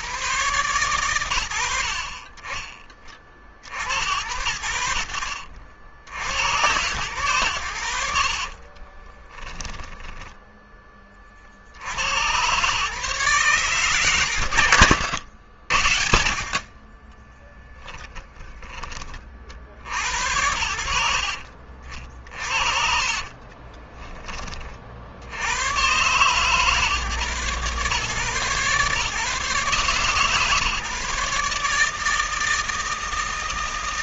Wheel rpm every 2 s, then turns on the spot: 120, 30, 80, 100, 30, 20, 130, 110, 30, 30, 90, 50, 60, 130, 140, 150, 160.
8-10 16-18 22-24